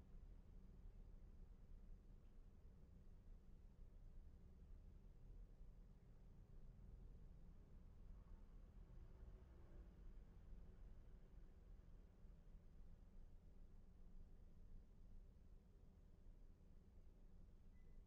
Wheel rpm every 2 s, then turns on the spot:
0, 0, 0, 0, 0, 0, 0, 0, 0.
none